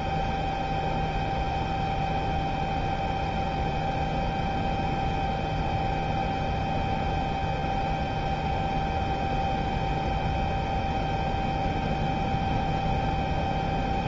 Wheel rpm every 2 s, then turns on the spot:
0, 0, 0, 0, 0, 0, 0.
none